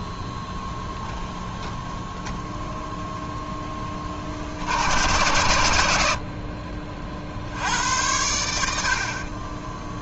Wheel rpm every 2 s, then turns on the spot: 10, 0, 60, 50, 80.
none